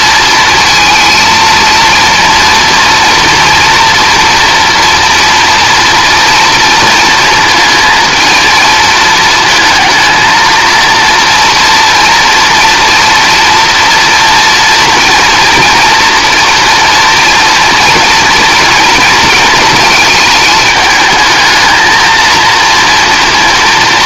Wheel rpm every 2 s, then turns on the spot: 230, 230, 230, 230, 220, 230, 230, 230, 230, 230, 210, 230.
none